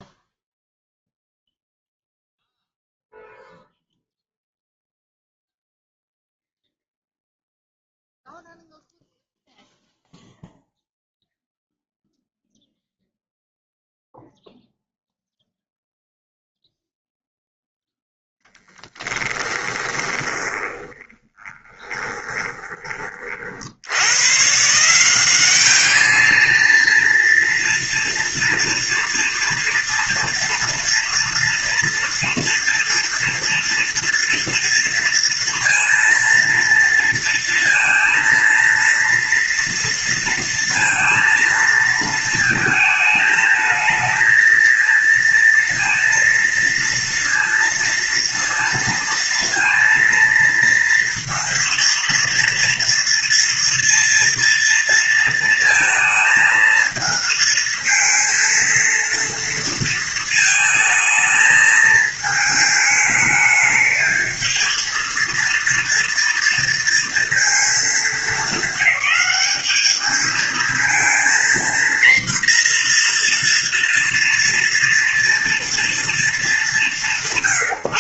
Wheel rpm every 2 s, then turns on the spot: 0, 0, 0, 0, 0, 0, 0, 0, 0, 10, 20, 40, 190, 230, 240, 230, 230, 230, 230, 230, 230, 220, 230, 230, 230, 230, 240, 230, 230, 230, 220, 210, 230, 230, 210, 230, 240, 240, 170.
18-22